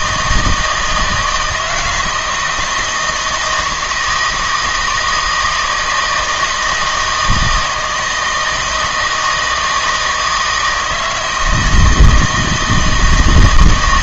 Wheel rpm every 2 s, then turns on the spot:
160, 170, 160, 160, 160, 160, 160.
none